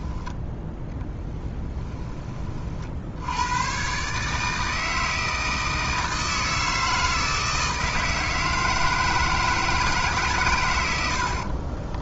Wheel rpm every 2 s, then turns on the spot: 10, 50, 160, 160, 160, 100.
none